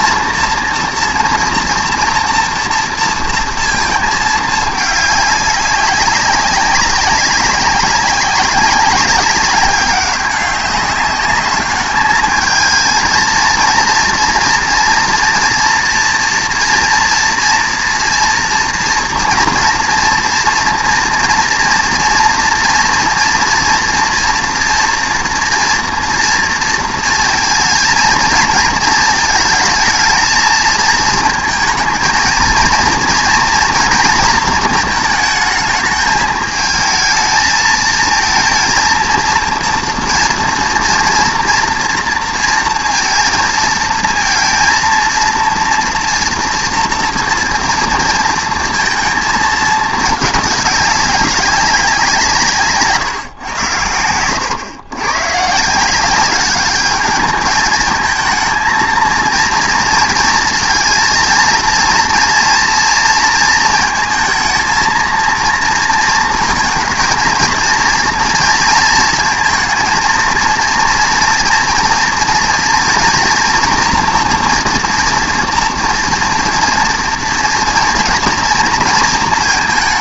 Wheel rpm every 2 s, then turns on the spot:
230, 230, 210, 200, 190, 200, 220, 230, 230, 230, 230, 230, 230, 230, 230, 230, 230, 230, 220, 230, 230, 230, 230, 230, 230, 210, 160, 110, 200, 220, 230, 230, 220, 220, 230, 230, 230, 230, 230, 230.
none